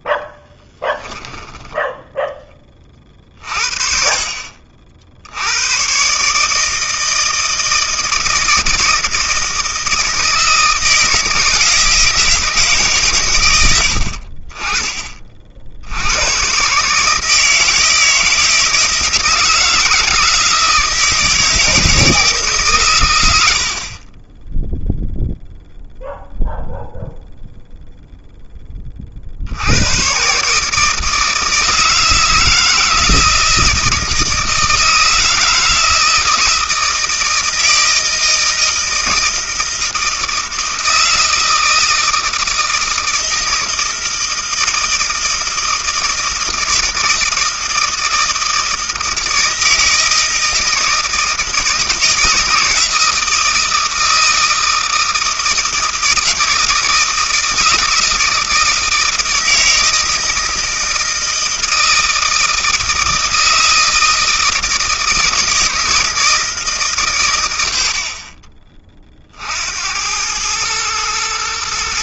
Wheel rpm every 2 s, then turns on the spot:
10, 30, 60, 160, 160, 160, 150, 30, 140, 160, 160, 120, 0, 0, 30, 150, 160, 160, 160, 160, 160, 160, 160, 160, 160, 160, 160, 160, 160, 160, 160, 160, 160, 140, 30, 110.
none